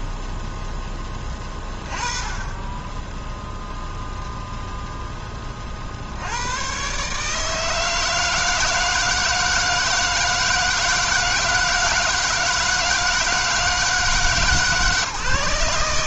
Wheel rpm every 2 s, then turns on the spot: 0, 20, 0, 90, 160, 160, 160, 150.
none